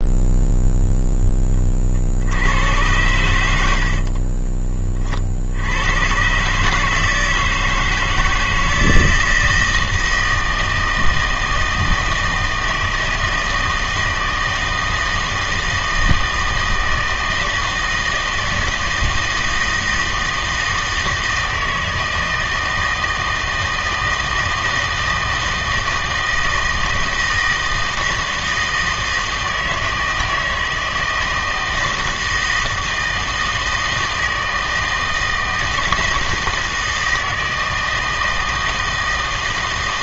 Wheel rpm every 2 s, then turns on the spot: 0, 90, 30, 140, 160, 160, 160, 160, 160, 160, 160, 160, 160, 160, 160, 160, 160, 160, 160, 160.
none